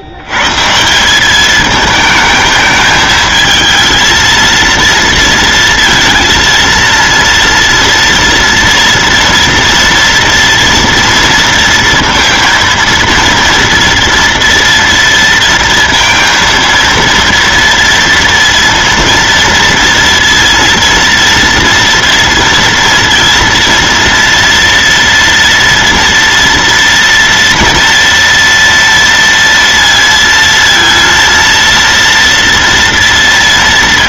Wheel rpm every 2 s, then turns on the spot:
120, 220, 230, 230, 230, 230, 230, 230, 230, 230, 230, 230, 230, 230, 230, 230, 230.
none